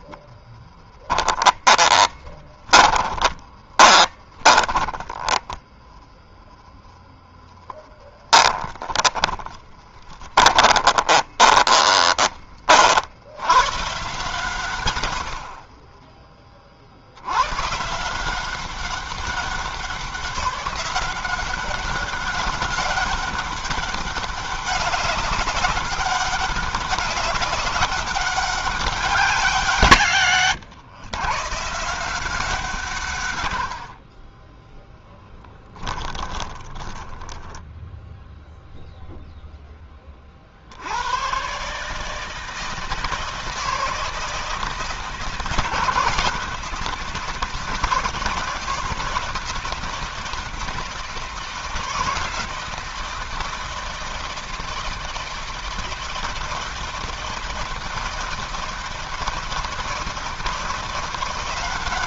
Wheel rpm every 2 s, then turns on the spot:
20, 10, 0, 20, 20, 20, 130, 20, 150, 190, 200, 200, 190, 200, 130, 150, 40, 10, 10, 0, 120, 160, 160, 160, 160, 160, 160, 160, 160, 170, 170.
0-4 6-10 34-38